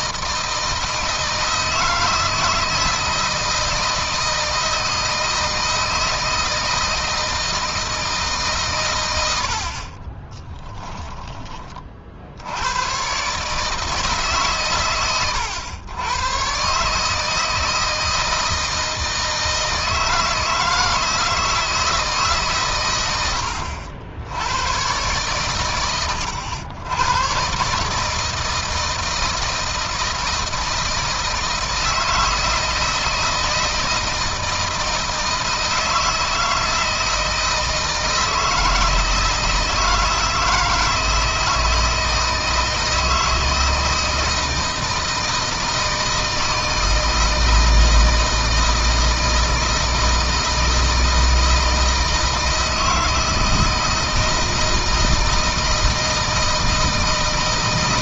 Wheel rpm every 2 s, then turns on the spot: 160, 160, 160, 160, 110, 20, 110, 120, 140, 160, 160, 100, 120, 100, 160, 160, 160, 160, 160, 160, 160, 160, 160, 160, 160, 160, 160, 160, 160.
none